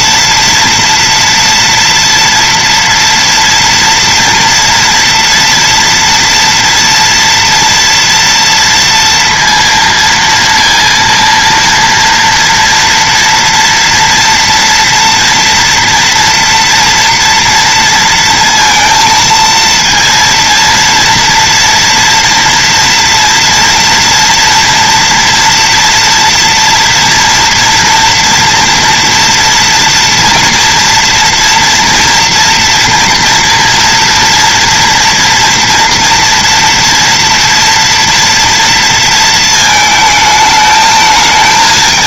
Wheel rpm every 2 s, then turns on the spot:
230, 230, 230, 230, 230, 230, 230, 230, 230, 230, 230, 230, 230, 230, 240, 230, 240, 230, 230, 230, 220.
none